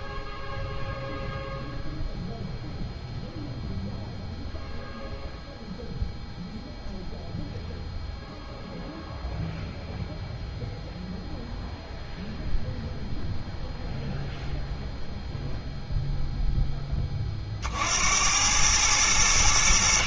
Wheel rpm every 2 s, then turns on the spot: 0, 0, 0, 0, 0, 0, 0, 0, 10, 100.
none